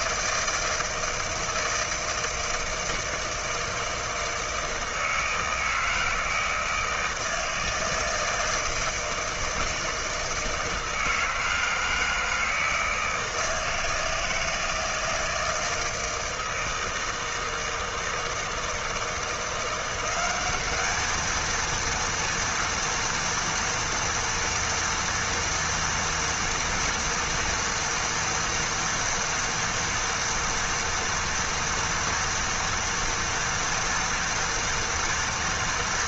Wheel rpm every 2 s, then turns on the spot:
160, 160, 160, 160, 160, 160, 160, 160, 160, 160, 200, 230, 230, 230, 230, 230, 230, 230.
none